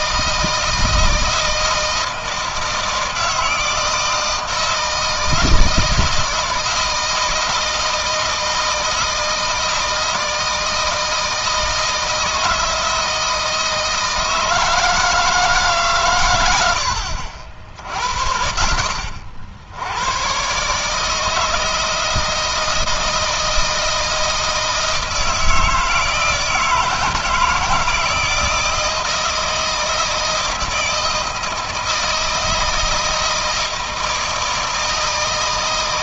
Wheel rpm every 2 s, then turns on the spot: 160, 160, 160, 160, 160, 160, 160, 160, 70, 60, 150, 160, 160, 160, 160, 160, 160, 160.
none